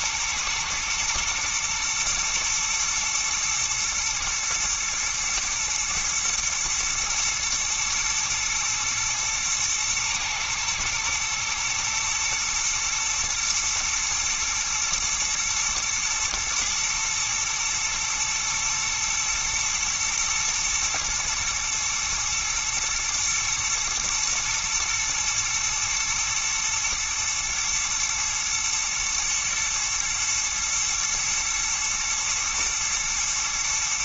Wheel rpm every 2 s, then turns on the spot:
120, 110, 110, 110, 110, 120, 120, 120, 110, 120, 110, 110, 110, 110, 110, 120, 110.
none